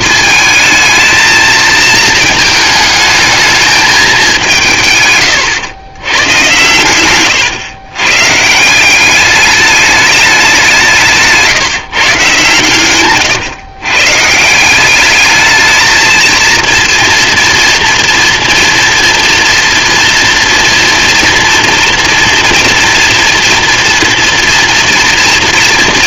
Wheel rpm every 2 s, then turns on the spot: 220, 220, 170, 100, 160, 190, 160, 190, 230, 230, 230, 230, 230.
none